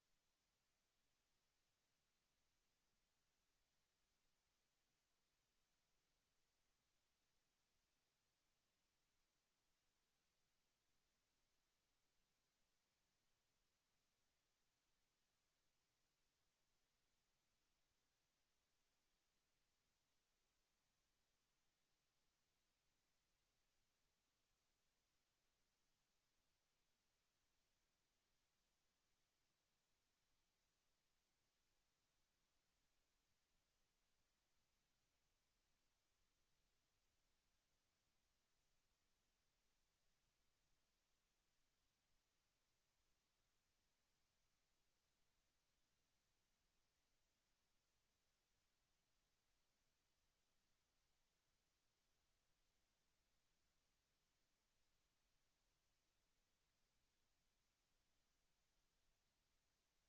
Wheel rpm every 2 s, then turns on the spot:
0, 0, 0, 0, 0, 0, 0, 0, 0, 0, 0, 0, 0, 0, 0, 0, 0, 0, 0, 0, 0, 0, 0, 0, 0, 0, 0, 0, 0, 0.
none